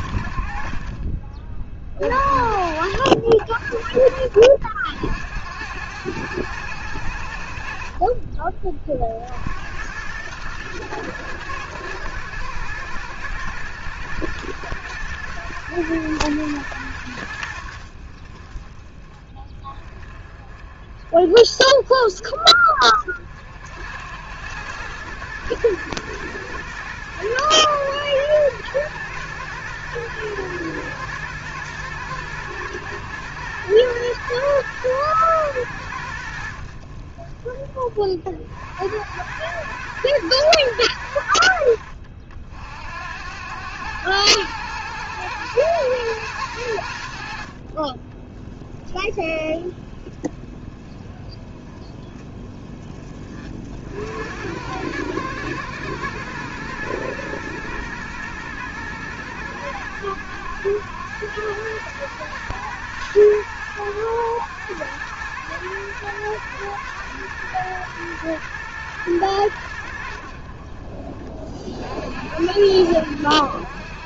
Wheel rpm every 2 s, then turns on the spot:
40, 50, 60, 90, 40, 110, 110, 110, 100, 30, 40, 40, 100, 110, 120, 120, 110, 120, 60, 80, 110, 60, 110, 80, 10, 20, 20, 100, 120, 120, 110, 120, 110, 120, 120, 40, 80.
none